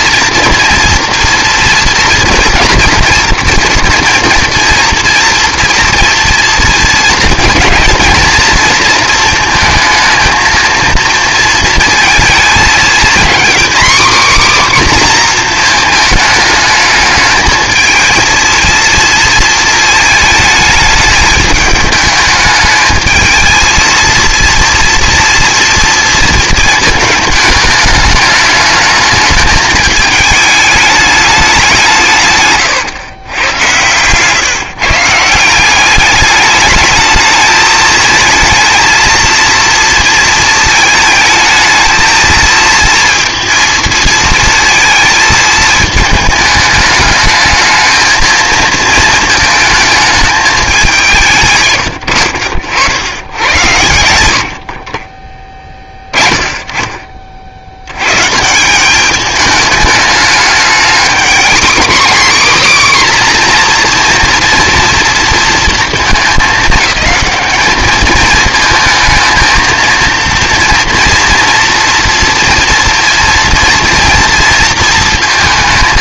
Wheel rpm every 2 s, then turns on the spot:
230, 230, 230, 230, 230, 220, 230, 260, 220, 230, 210, 220, 230, 220, 210, 210, 130, 150, 210, 220, 230, 230, 230, 210, 230, 210, 70, 50, 10, 160, 210, 250, 230, 220, 220, 230, 230, 230.
none